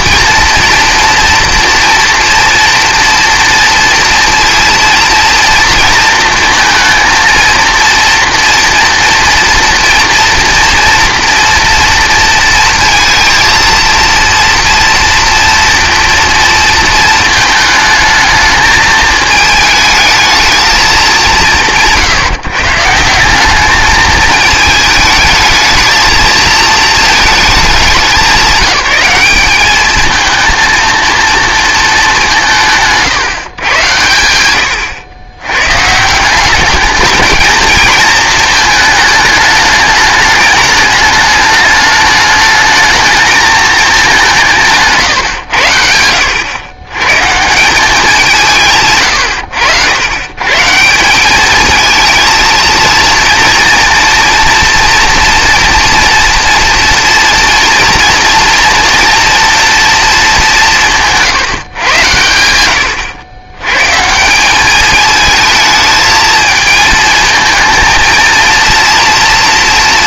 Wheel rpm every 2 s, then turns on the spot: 240, 230, 230, 230, 230, 240, 230, 230, 230, 220, 220, 140, 220, 220, 180, 230, 160, 100, 200, 220, 210, 210, 160, 100, 160, 150, 220, 230, 230, 230, 190, 100, 200, 220, 230.
none